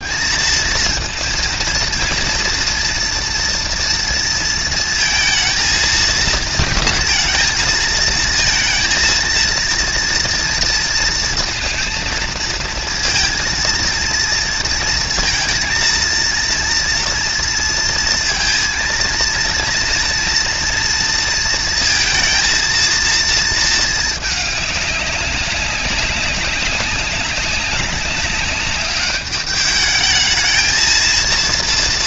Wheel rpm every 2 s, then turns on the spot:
230, 230, 220, 230, 230, 230, 230, 230, 230, 230, 230, 220, 200, 190, 200, 230.
none